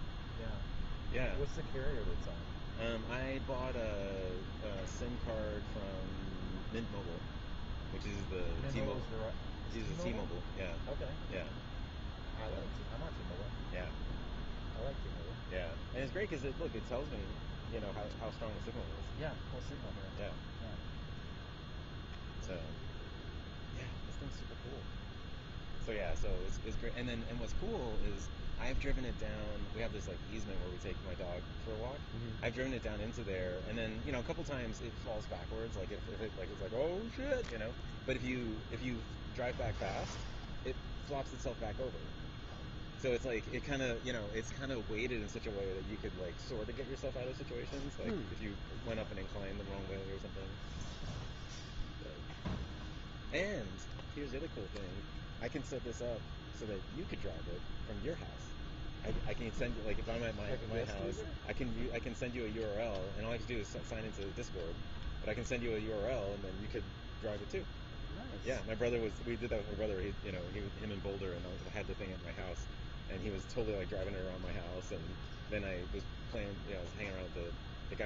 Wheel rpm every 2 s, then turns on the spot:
0, 0, 0, 0, 0, 0, 0, 0, 0, 0, 0, 0, 0, 0, 0, 0, 0, 0, 0, 0, 0, 0, 0, 0, 0, 0, 0, 0, 0, 0, 0, 0, 0, 0, 0, 0, 0, 0, 0.
none